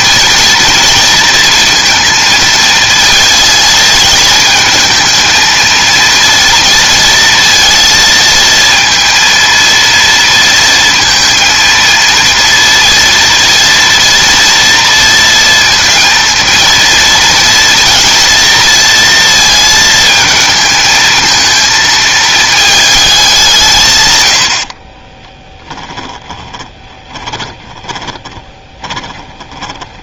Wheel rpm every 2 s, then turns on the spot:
230, 230, 220, 230, 230, 230, 230, 230, 230, 230, 220, 220, 60, 20, 20.
26-30